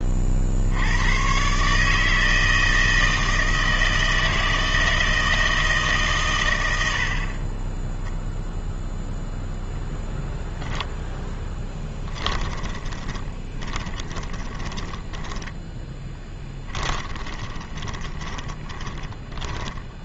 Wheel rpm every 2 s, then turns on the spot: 70, 160, 160, 90, 0, 0, 20, 10, 20, 20.
12-20